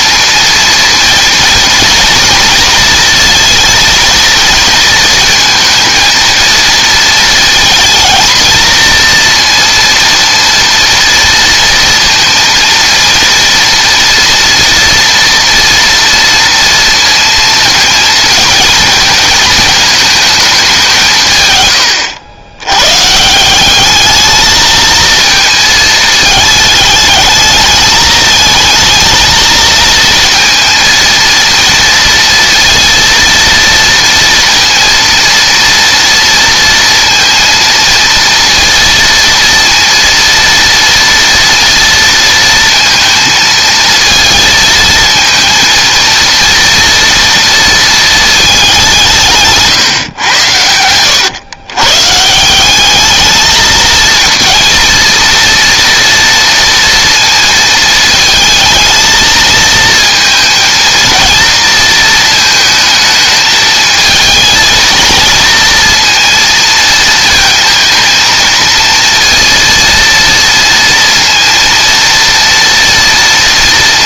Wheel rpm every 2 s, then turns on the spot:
230, 230, 230, 230, 230, 230, 230, 230, 230, 230, 200, 90, 220, 210, 220, 230, 230, 230, 230, 230, 230, 230, 220, 230, 200, 110, 180, 230, 230, 220, 230, 220, 230, 230, 230, 230, 230.
none